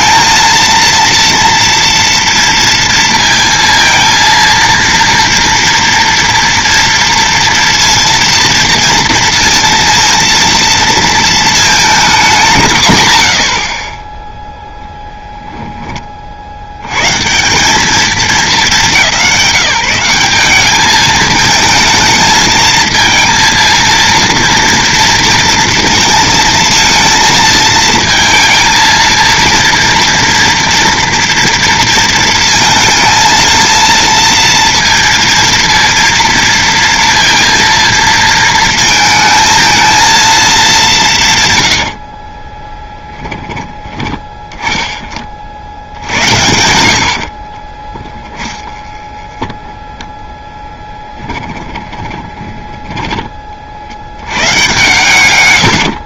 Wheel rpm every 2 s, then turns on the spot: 230, 230, 230, 230, 230, 230, 130, 0, 100, 180, 210, 220, 230, 230, 230, 230, 220, 230, 230, 230, 180, 10, 20, 80, 20, 10, 10, 110.
42-44 48-54